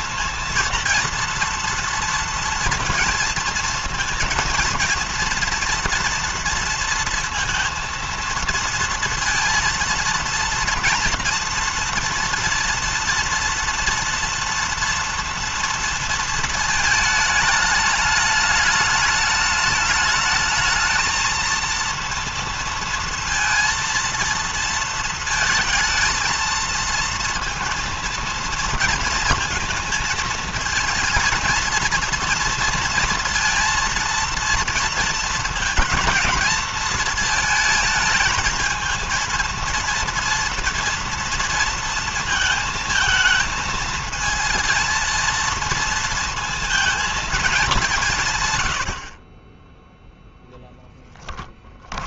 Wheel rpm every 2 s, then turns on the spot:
230, 230, 230, 230, 230, 230, 230, 230, 220, 210, 220, 230, 230, 230, 230, 230, 230, 230, 230, 220, 230, 220, 230, 220, 80, 0.
none